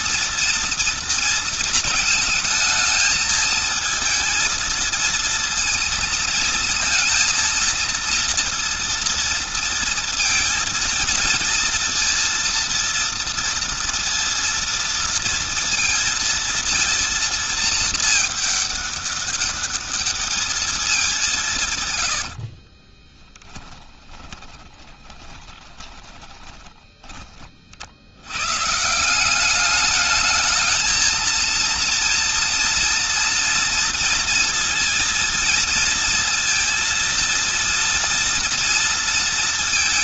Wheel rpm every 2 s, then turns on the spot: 230, 220, 230, 230, 230, 230, 230, 230, 230, 210, 200, 20, 30, 20, 160, 220, 230, 230, 230, 230.
22-26